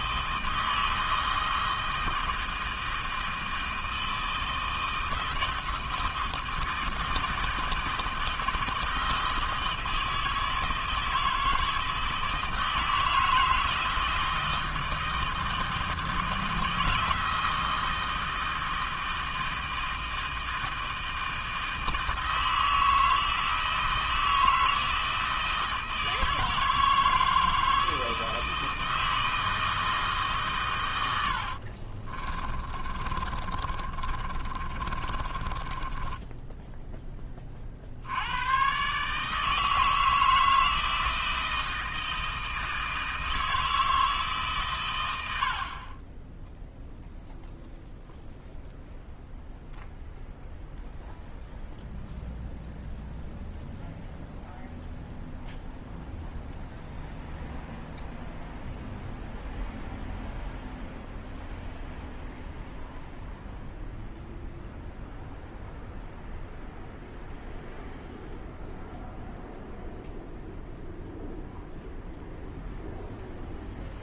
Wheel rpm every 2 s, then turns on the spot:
160, 160, 160, 160, 160, 160, 160, 160, 160, 160, 160, 160, 160, 160, 160, 100, 30, 30, 10, 140, 160, 160, 120, 0, 0, 0, 0, 0, 0, 0, 0, 0, 0, 0, 0, 0, 0.
32-36